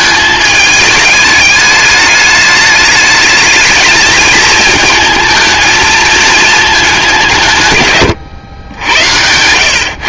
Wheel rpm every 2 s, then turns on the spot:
210, 220, 220, 160, 100.
none